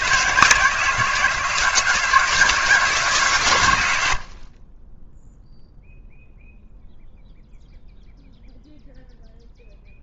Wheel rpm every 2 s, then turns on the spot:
170, 150, 20, 0, 0.
none